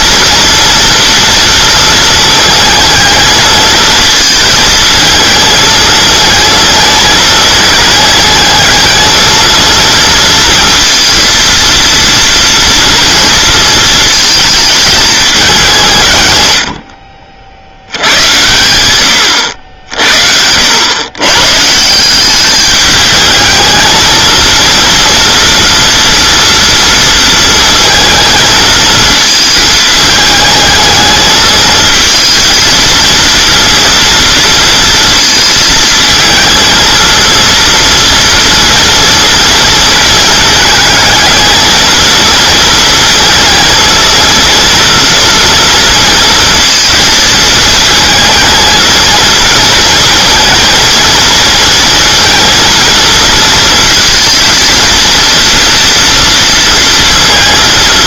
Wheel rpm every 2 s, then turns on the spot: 230, 220, 220, 220, 220, 230, 230, 210, 90, 110, 100, 210, 230, 230, 230, 220, 230, 230, 230, 230, 220, 230, 240, 230, 220, 230, 230, 230, 230.
none